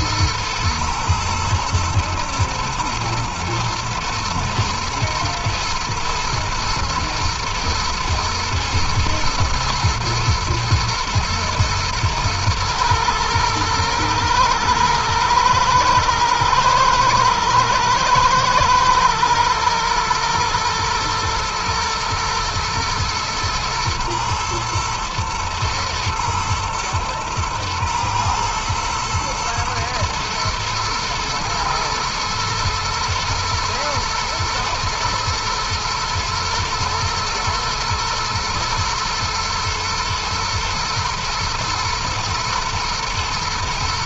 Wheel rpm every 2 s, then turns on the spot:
120, 120, 120, 110, 120, 120, 120, 110, 110, 110, 110, 120, 120, 110, 110, 110, 110, 120, 120, 110, 110, 120.
none